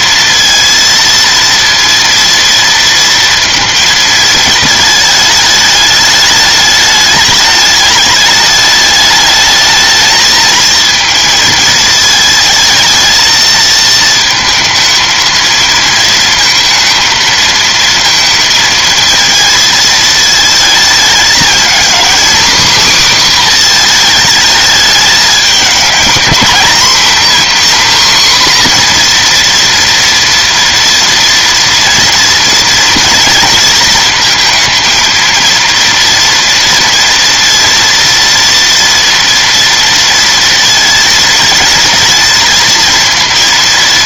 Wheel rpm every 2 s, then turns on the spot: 230, 230, 220, 210, 210, 220, 220, 220, 230, 220, 220, 270, 220, 250, 250, 240, 240, 230, 230, 230, 230, 230.
none